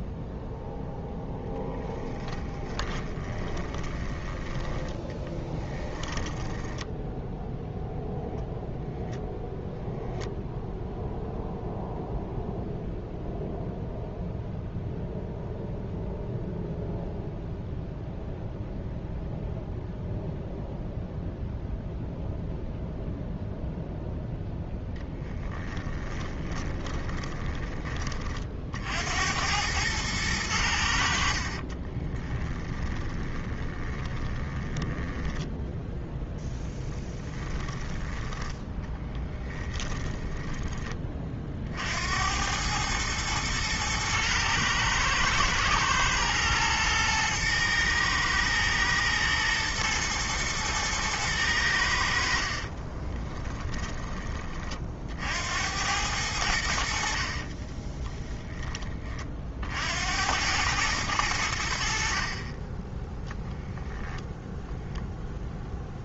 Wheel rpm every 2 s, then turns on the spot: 0, 20, 10, 10, 0, 0, 0, 0, 0, 0, 0, 0, 0, 10, 50, 90, 20, 10, 10, 10, 20, 100, 120, 110, 110, 110, 40, 40, 70, 20, 100, 20, 0.
2-4 26-28 32-38 52-54